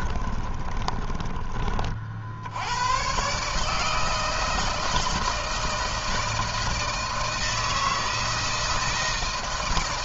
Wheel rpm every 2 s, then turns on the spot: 20, 110, 160, 160, 160.
0-2